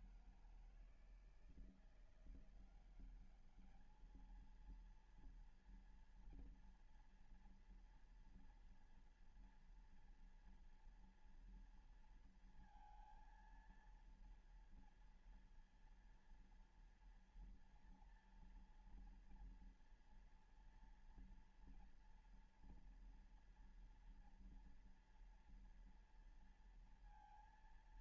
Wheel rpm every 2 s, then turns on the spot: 160, 180, 220, 230, 240, 230, 230, 230, 230, 230, 230, 230, 230, 230.
none